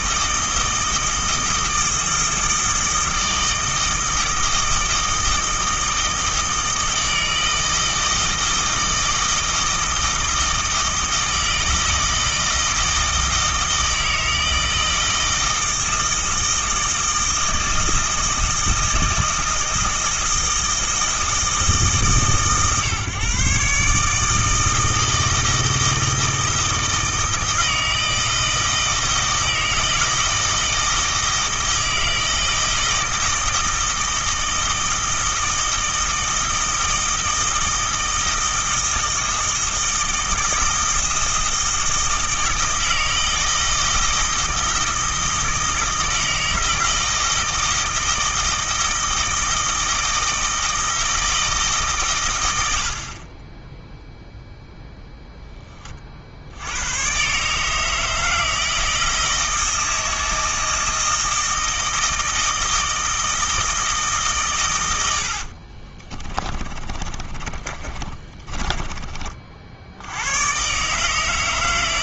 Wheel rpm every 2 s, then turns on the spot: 160, 160, 160, 160, 160, 160, 160, 160, 160, 160, 160, 140, 160, 160, 160, 160, 160, 160, 160, 160, 160, 160, 160, 160, 160, 160, 70, 0, 90, 160, 160, 160, 110, 30, 20, 140.
66-70